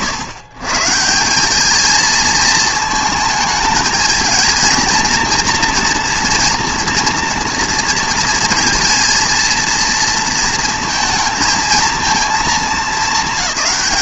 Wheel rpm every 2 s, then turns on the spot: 130, 230, 230, 230, 230, 230, 220.
none